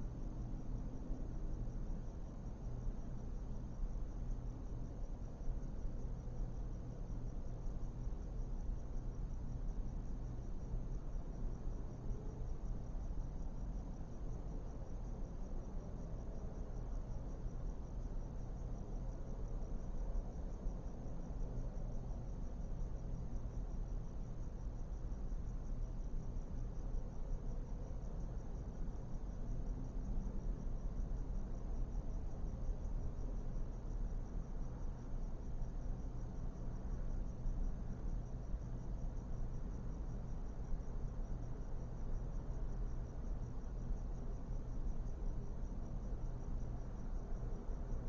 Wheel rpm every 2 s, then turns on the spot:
0, 0, 0, 0, 0, 0, 0, 0, 0, 0, 0, 0, 0, 0, 0, 0, 0, 0, 0, 0, 0, 0, 0, 0.
none